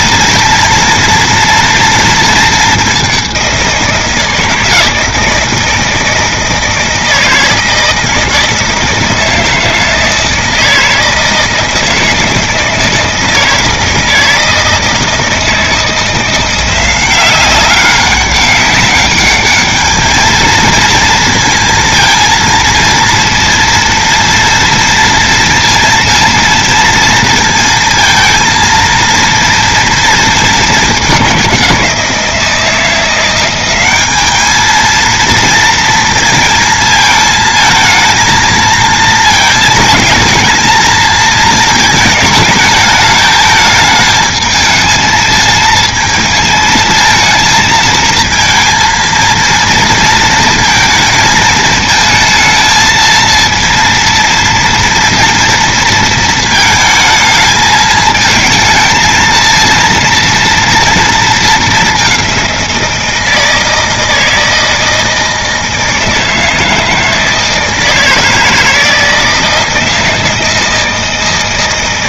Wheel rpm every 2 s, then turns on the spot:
230, 220, 160, 160, 160, 160, 160, 160, 170, 200, 220, 230, 230, 230, 220, 220, 170, 220, 220, 230, 230, 220, 220, 220, 230, 230, 220, 230, 220, 220, 230, 180, 160, 160, 160, 160.
none